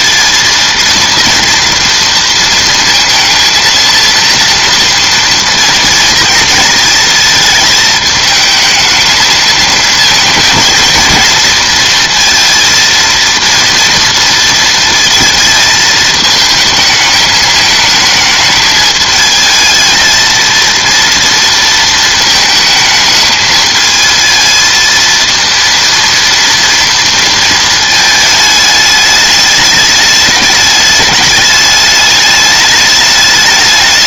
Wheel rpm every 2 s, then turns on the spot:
230, 230, 230, 230, 220, 220, 230, 230, 220, 220, 230, 220, 220, 230, 220, 210, 210.
none